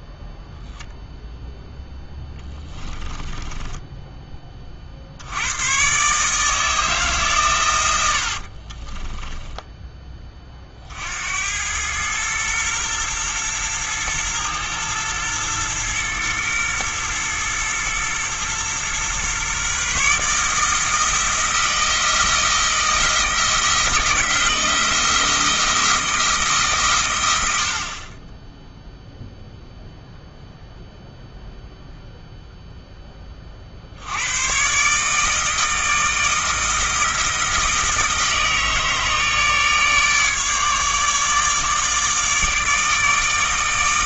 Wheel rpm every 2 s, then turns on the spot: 0, 10, 50, 160, 30, 60, 120, 120, 120, 120, 160, 160, 160, 130, 0, 0, 0, 140, 160, 160, 150, 160.
2-4 8-10